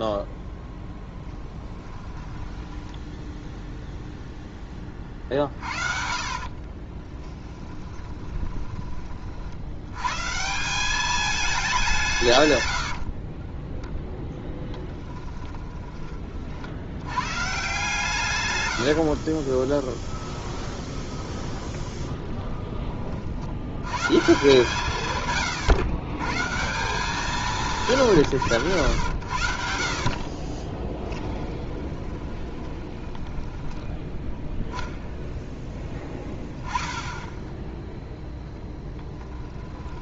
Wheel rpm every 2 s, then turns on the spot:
10, 10, 10, 40, 20, 170, 110, 10, 70, 100, 20, 20, 150, 160, 100, 20, 20, 20, 10, 0.
0-4 6-10 18-22 30-34